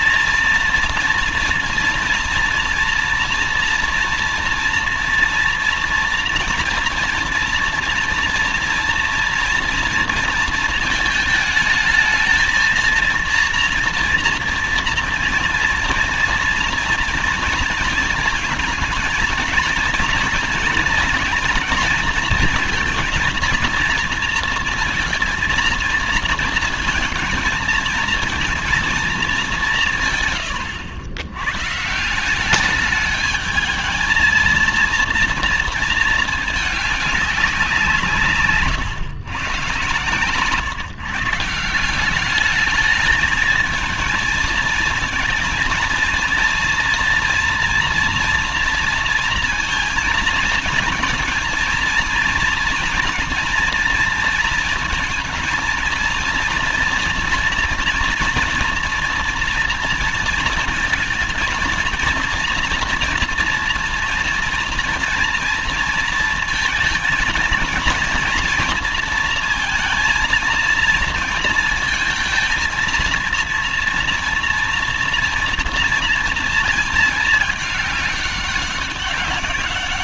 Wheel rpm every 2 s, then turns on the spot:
230, 240, 230, 230, 230, 230, 230, 230, 230, 220, 230, 230, 230, 230, 230, 140, 200, 220, 220, 140, 140, 200, 220, 230, 230, 230, 230, 230, 230, 230, 230, 230, 230, 230, 230, 230, 230, 230, 230, 200.
none